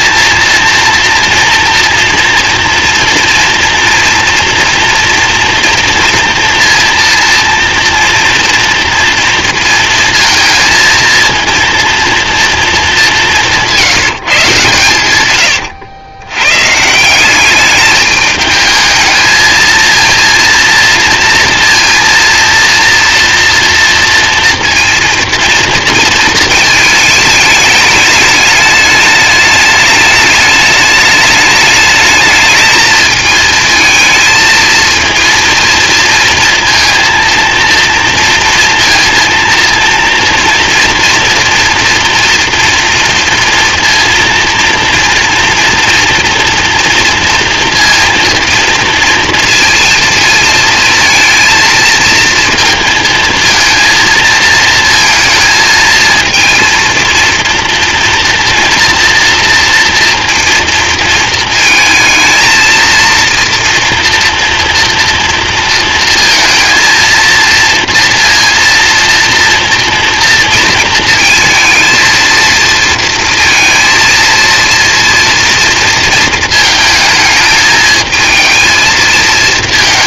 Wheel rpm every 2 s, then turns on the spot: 230, 240, 230, 230, 230, 230, 200, 120, 180, 220, 230, 230, 230, 220, 210, 210, 220, 230, 230, 230, 230, 230, 230, 240, 230, 230, 230, 220, 230, 230, 230, 230, 230, 230, 230, 230, 230, 230, 220, 220.
14-16